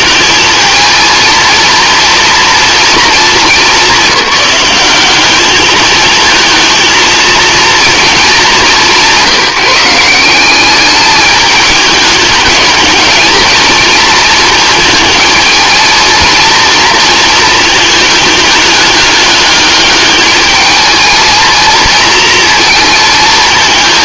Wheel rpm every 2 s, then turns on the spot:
230, 220, 200, 220, 190, 200, 210, 220, 230, 210, 220, 230.
none